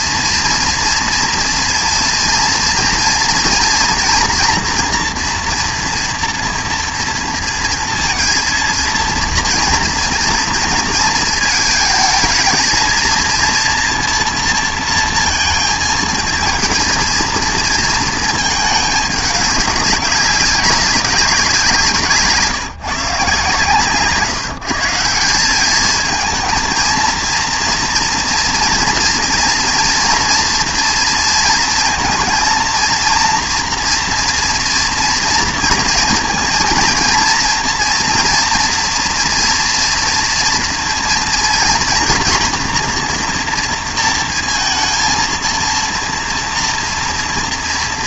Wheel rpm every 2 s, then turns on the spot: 230, 230, 240, 240, 230, 230, 230, 230, 220, 220, 200, 150, 160, 230, 230, 230, 230, 230, 230, 230, 230, 240, 230, 240.
none